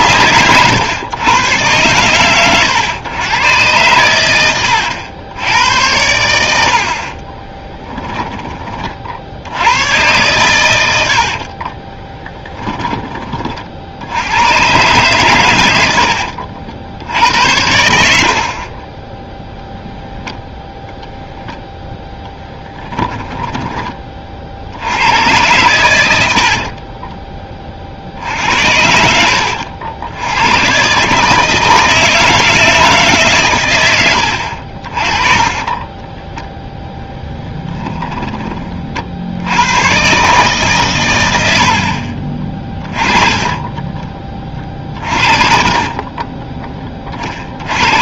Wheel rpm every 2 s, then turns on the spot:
110, 120, 90, 80, 20, 100, 20, 120, 70, 40, 0, 10, 60, 40, 70, 120, 160, 70, 10, 30, 140, 40, 40, 20.
22-24 26-28 34-36 42-46